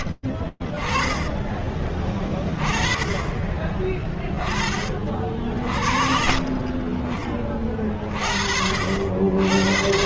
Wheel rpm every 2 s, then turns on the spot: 40, 30, 30, 40, 50.
none